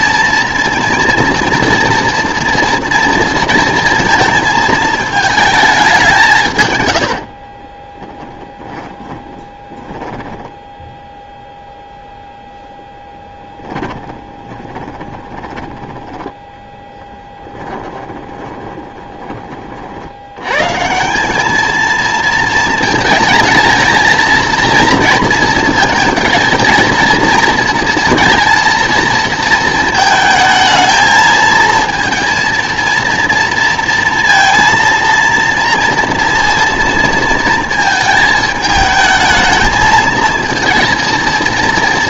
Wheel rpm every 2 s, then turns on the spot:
230, 230, 220, 120, 20, 10, 0, 20, 20, 10, 130, 220, 230, 220, 230, 220, 230, 230, 230, 220, 230.
8-10 14-20